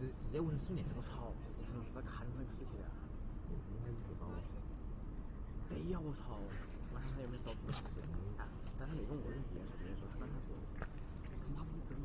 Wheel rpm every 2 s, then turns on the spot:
0, 0, 0, 0, 0, 0.
none